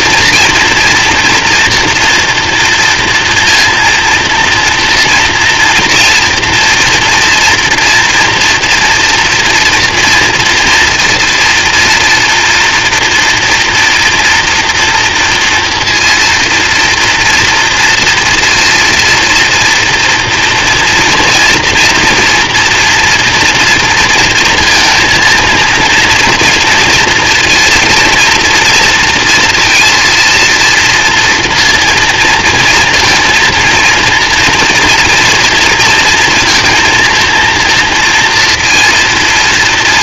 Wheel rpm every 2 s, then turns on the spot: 230, 230, 230, 230, 230, 230, 240, 240, 240, 230, 230, 230, 230, 230, 230, 230, 230, 230, 230, 230.
none